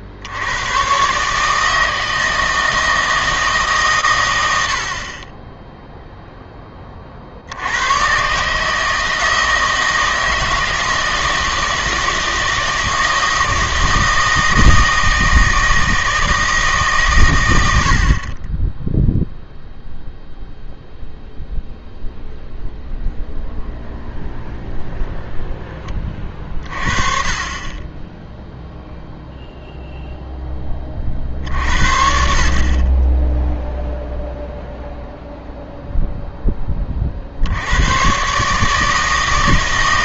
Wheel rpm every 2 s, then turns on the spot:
110, 160, 80, 20, 150, 160, 160, 160, 150, 20, 0, 0, 0, 30, 0, 20, 30, 0, 20, 150.
none